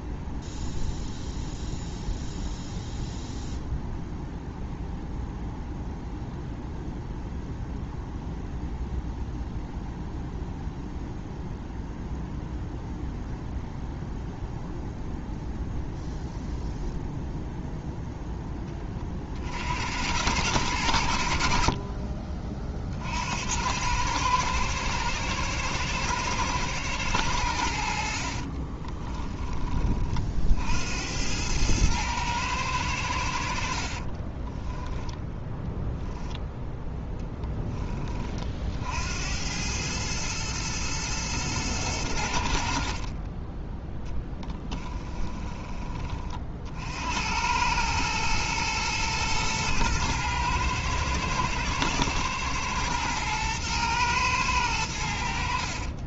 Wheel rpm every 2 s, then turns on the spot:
0, 0, 0, 0, 0, 0, 0, 0, 0, 20, 100, 50, 120, 110, 30, 70, 100, 10, 10, 60, 110, 50, 10, 50, 110, 110, 110, 100.
28-30 36-38 42-46